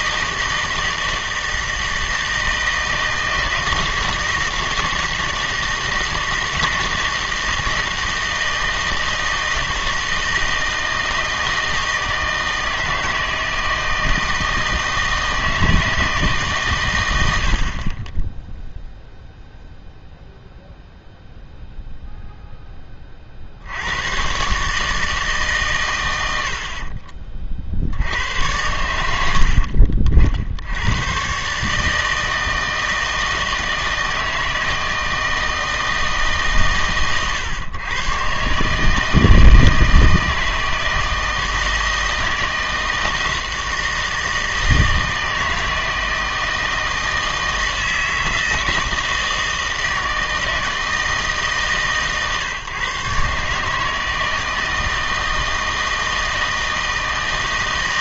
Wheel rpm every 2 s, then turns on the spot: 160, 160, 160, 160, 160, 160, 160, 160, 130, 0, 0, 20, 150, 50, 90, 90, 160, 160, 130, 150, 160, 160, 160, 160, 160, 160, 130, 160, 160.
none